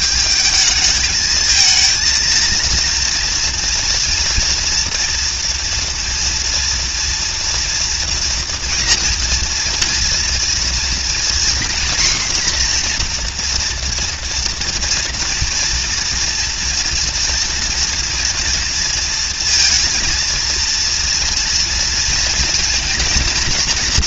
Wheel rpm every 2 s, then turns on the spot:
210, 220, 230, 230, 240, 230, 250, 240, 230, 230, 230, 240.
none